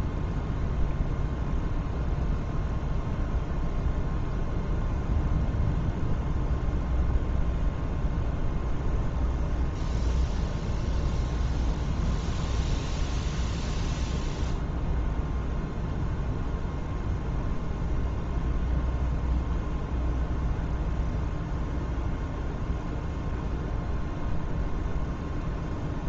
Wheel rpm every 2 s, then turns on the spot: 0, 0, 0, 0, 0, 0, 0, 0, 0, 0, 0, 0, 0.
none